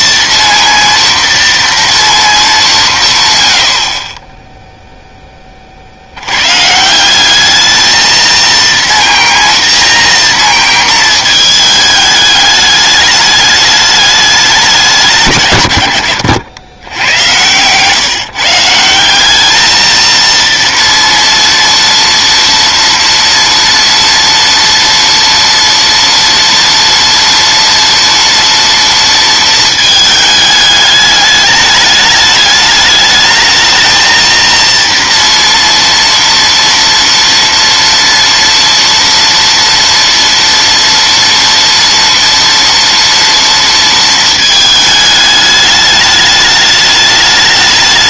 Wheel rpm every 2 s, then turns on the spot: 230, 130, 10, 170, 230, 230, 210, 150, 100, 180, 230, 230, 230, 230, 230, 210, 210, 230, 230, 230, 230, 230, 210, 210.
none